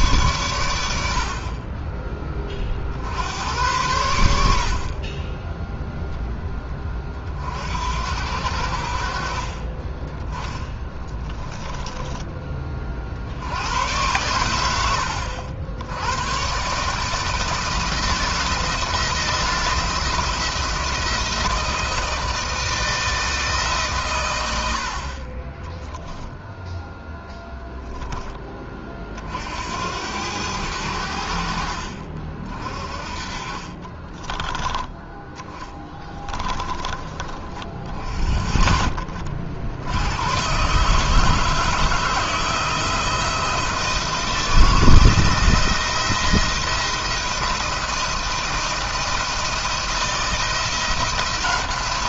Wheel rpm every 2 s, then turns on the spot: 110, 30, 70, 10, 70, 10, 30, 100, 120, 160, 170, 160, 90, 0, 20, 90, 40, 10, 20, 40, 120, 160, 160, 170, 170, 170.
34-36